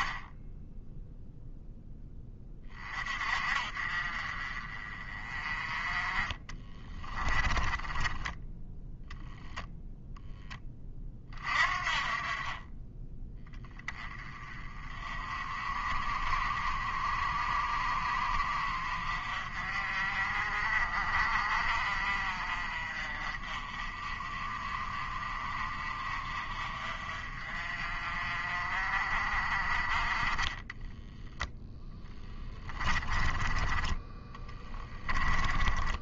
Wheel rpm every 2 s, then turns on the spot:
10, 30, 40, 30, 0, 20, 20, 30, 40, 50, 40, 40, 40, 40, 40, 20, 20, 20.
6-8 30-36